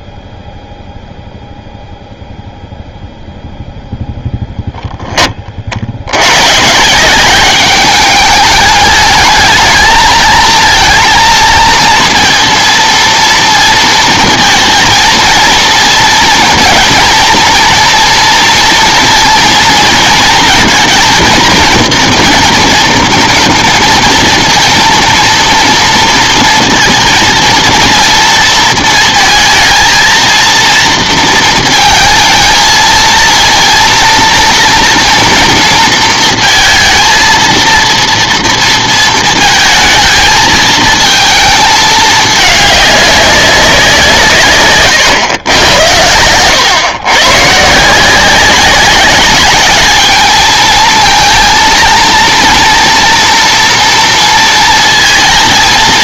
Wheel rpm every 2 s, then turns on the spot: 0, 0, 0, 130, 210, 220, 230, 230, 230, 230, 230, 240, 230, 230, 230, 230, 220, 230, 230, 230, 220, 210, 130, 120, 200, 220, 230, 230.
none